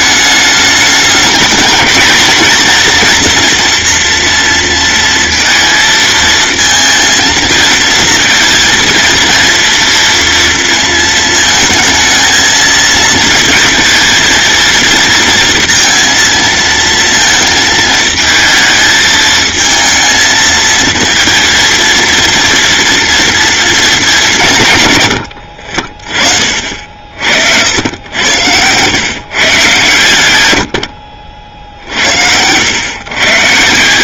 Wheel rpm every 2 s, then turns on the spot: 210, 240, 230, 230, 230, 230, 230, 230, 230, 220, 230, 230, 140, 60, 110, 90, 110.
none